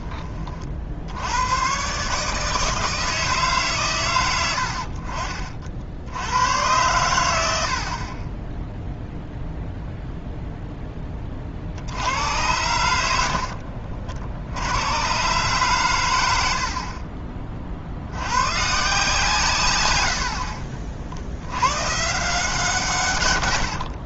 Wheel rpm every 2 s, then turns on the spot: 50, 160, 70, 100, 10, 0, 90, 90, 60, 140, 60, 160.
none